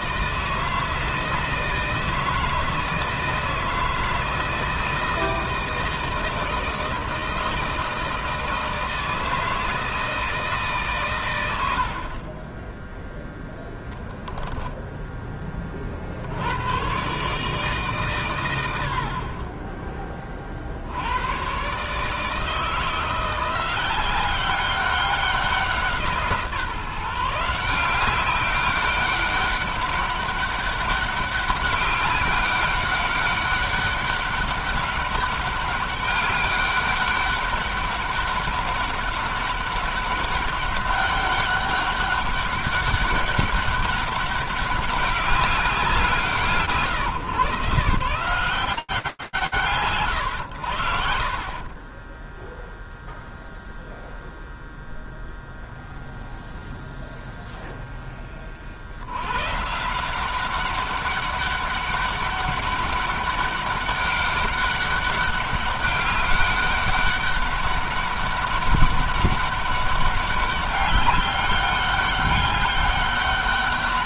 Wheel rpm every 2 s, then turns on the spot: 160, 160, 160, 160, 160, 160, 50, 0, 50, 150, 30, 140, 180, 170, 180, 200, 200, 200, 200, 200, 200, 200, 190, 170, 150, 80, 10, 0, 0, 30, 190, 200, 200, 200, 200, 200, 200.
none